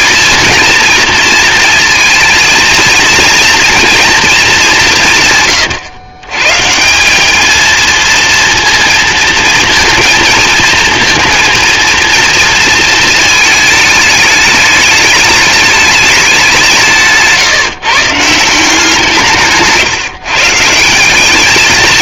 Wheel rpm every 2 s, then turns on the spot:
230, 230, 190, 170, 230, 230, 230, 210, 170, 170, 170.
none